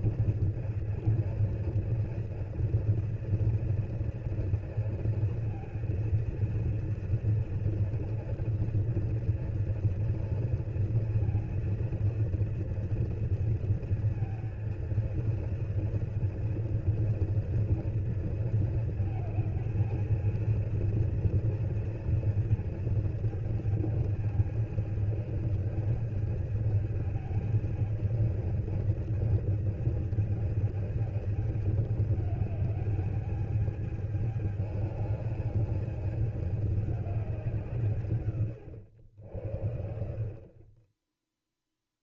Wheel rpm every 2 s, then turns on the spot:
240, 230, 230, 230, 230, 230, 230, 230, 230, 220, 230, 230, 220, 220, 220, 220, 210, 210, 210, 110, 30.
none